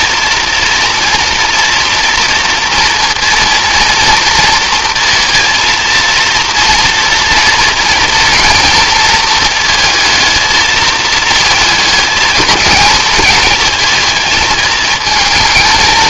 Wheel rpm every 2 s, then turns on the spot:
230, 230, 230, 230, 230, 220, 220, 220.
none